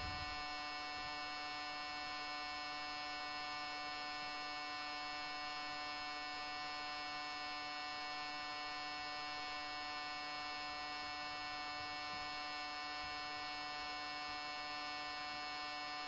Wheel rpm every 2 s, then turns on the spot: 0, 0, 0, 0, 0, 0, 0, 0.
none